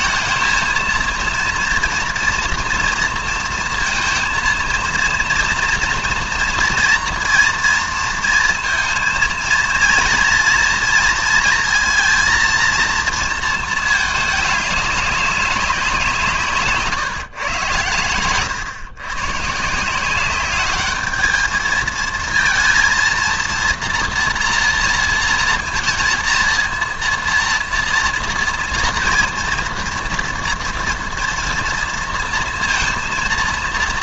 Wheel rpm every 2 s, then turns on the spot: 230, 230, 230, 230, 230, 230, 230, 200, 150, 120, 200, 230, 240, 230, 230, 230, 230.
none